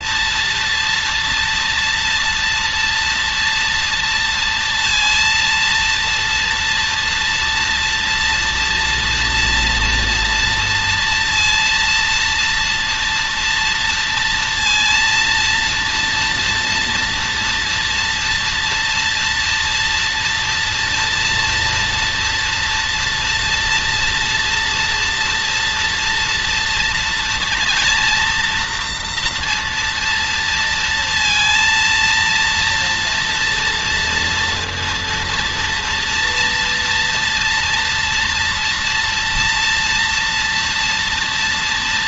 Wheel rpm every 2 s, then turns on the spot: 230, 230, 230, 230, 230, 230, 230, 230, 230, 240, 230, 230, 230, 240, 240, 230, 230, 230, 230, 230, 230.
none